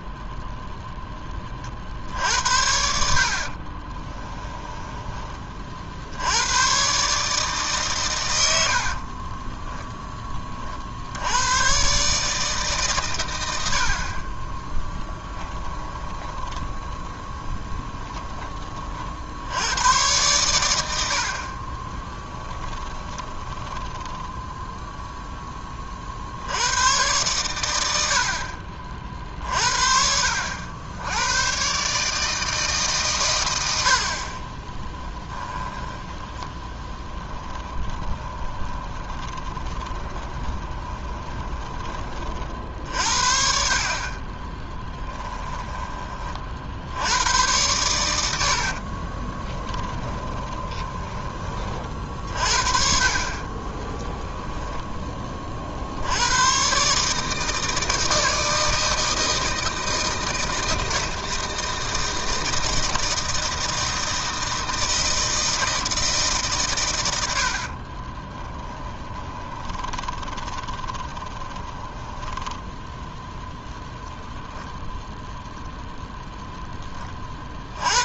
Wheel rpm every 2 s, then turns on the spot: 0, 70, 10, 130, 60, 50, 130, 20, 20, 40, 90, 20, 0, 90, 40, 90, 150, 10, 10, 20, 20, 50, 20, 70, 40, 20, 40, 10, 140, 160, 160, 160, 160, 120, 20, 20, 10, 10, 10.
4-6 8-10 14-18 22-24 34-42 44-46 48-52 68-72